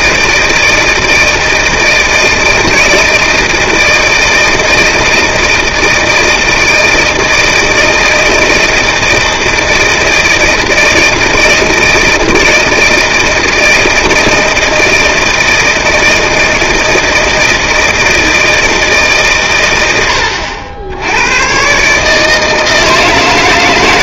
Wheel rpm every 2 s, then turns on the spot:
160, 160, 160, 160, 160, 160, 160, 160, 160, 130, 110, 160.
none